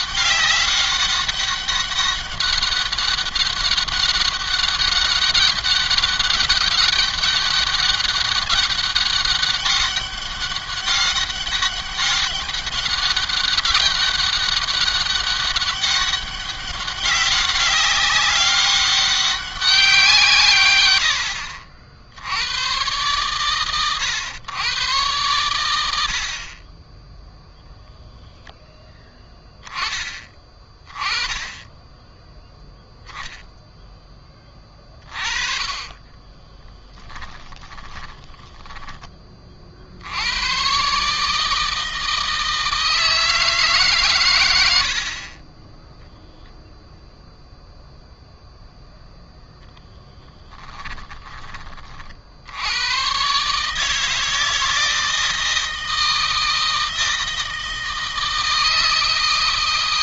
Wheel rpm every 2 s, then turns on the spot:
200, 200, 200, 200, 200, 200, 200, 190, 190, 190, 100, 120, 120, 20, 10, 20, 0, 30, 10, 10, 130, 160, 60, 0, 0, 10, 100, 160, 160, 160.
36-38 44-46 50-52